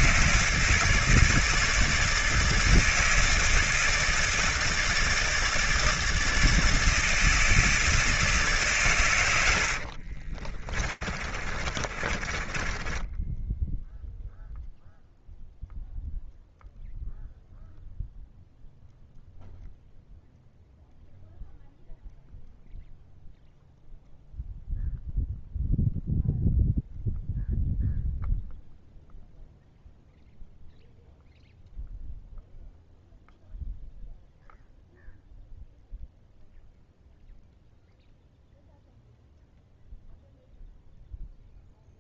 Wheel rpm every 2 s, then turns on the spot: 160, 160, 160, 160, 110, 40, 10, 0, 0, 0, 0, 0, 0, 0, 0, 0, 0, 0, 0, 0, 0.
10-14